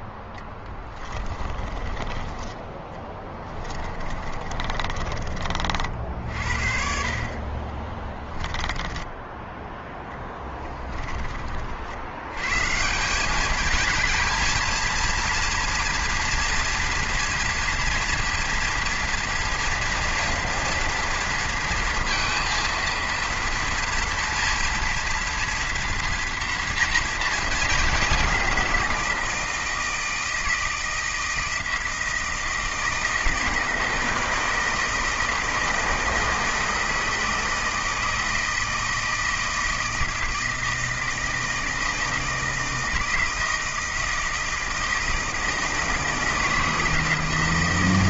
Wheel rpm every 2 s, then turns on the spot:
10, 10, 30, 50, 10, 10, 140, 230, 230, 230, 230, 230, 230, 230, 190, 160, 160, 160, 160, 160, 160, 160, 160, 160.
0-2 4-6 8-12